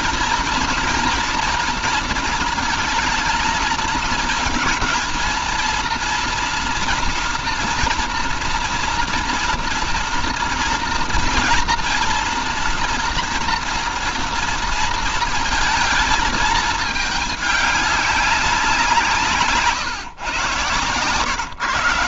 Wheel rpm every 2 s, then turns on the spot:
230, 230, 230, 230, 230, 230, 230, 210, 160, 130, 200.
none